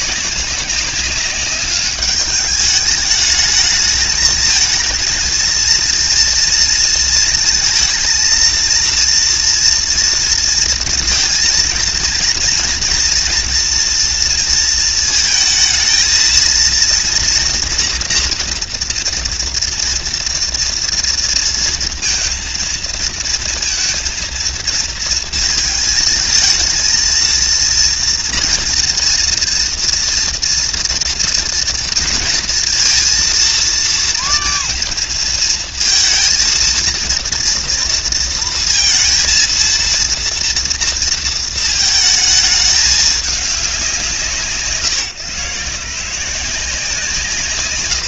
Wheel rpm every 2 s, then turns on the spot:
190, 210, 220, 230, 230, 230, 230, 230, 230, 230, 230, 220, 230, 230, 240, 240, 230, 230, 230, 230, 230, 220, 150, 170.
none